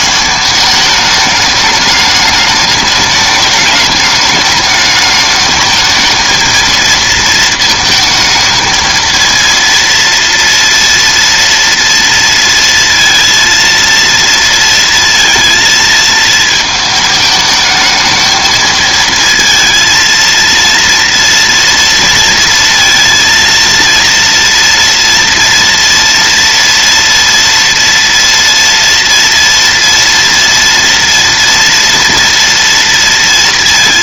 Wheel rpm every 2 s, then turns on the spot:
210, 210, 210, 230, 220, 230, 230, 230, 220, 220, 230, 230, 230, 230, 230, 230, 230.
none